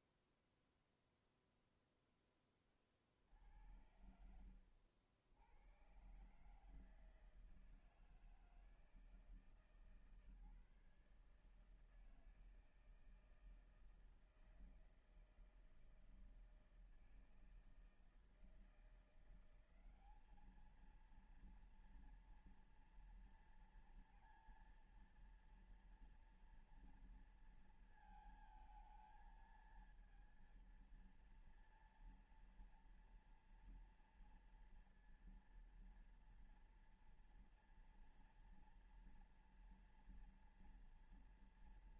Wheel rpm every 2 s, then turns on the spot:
0, 60, 90, 160, 160, 150, 160, 160, 160, 180, 220, 240, 230, 230, 220, 230, 230, 230, 230, 230, 230.
none